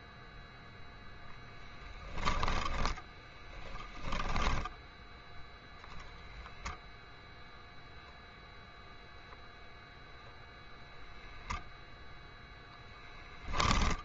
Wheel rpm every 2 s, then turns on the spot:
0, 10, 10, 10, 0, 0, 0.
none